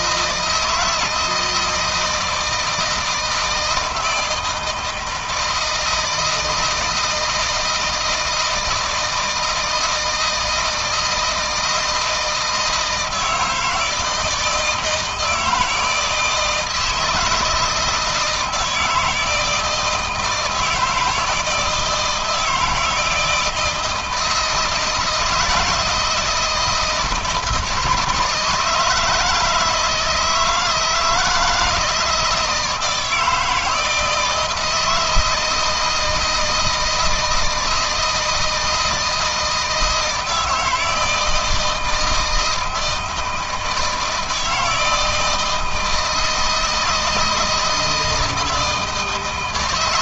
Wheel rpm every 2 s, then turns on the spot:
160, 160, 160, 160, 160, 160, 160, 160, 160, 160, 160, 160, 160, 160, 150, 170, 160, 160, 160, 160, 160, 160, 160, 160, 160.
none